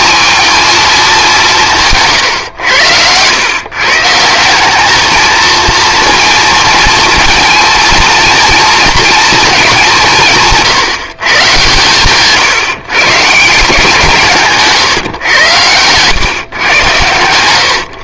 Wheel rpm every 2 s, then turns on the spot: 220, 100, 200, 230, 220, 150, 140, 140, 120.
2-4 14-16